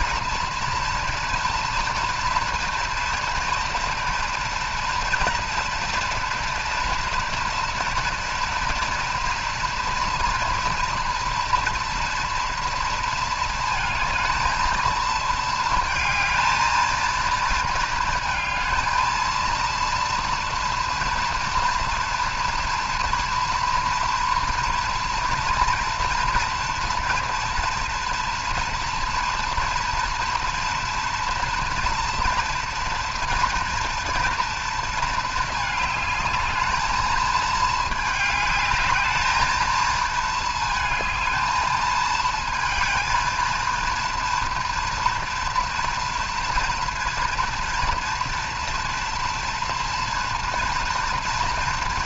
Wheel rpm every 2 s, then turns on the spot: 230, 240, 230, 230, 240, 230, 230, 220, 230, 220, 230, 230, 230, 230, 230, 230, 230, 230, 220, 220, 220, 230, 230, 230, 240, 240.
none